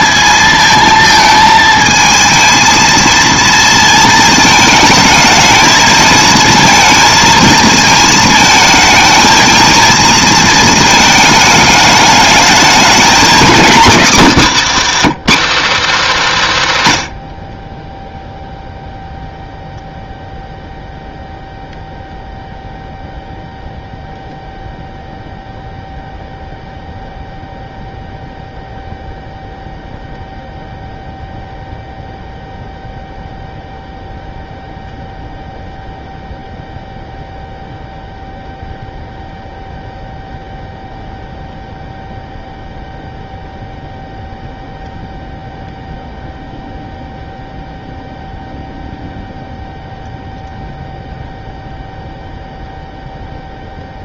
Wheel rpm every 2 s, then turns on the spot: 220, 230, 220, 230, 220, 230, 220, 270, 190, 0, 0, 0, 0, 0, 0, 0, 0, 0, 0, 0, 0, 0, 0, 0, 0, 0, 0.
14-16